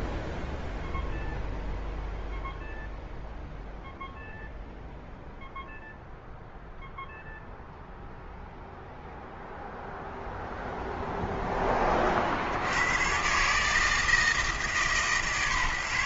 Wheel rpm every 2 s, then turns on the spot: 0, 0, 0, 0, 0, 0, 80, 160.
none